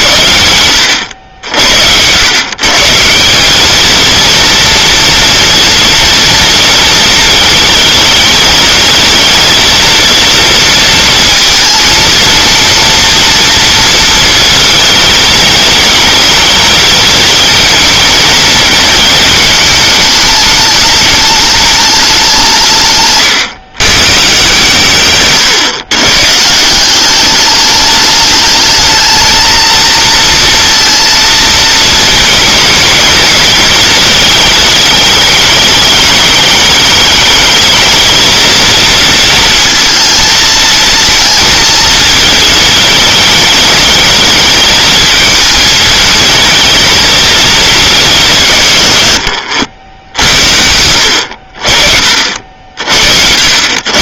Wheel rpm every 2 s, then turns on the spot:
90, 160, 230, 230, 220, 230, 230, 220, 220, 220, 210, 150, 140, 180, 220, 230, 220, 210, 210, 230, 220, 210, 220, 220, 100, 70, 60.
none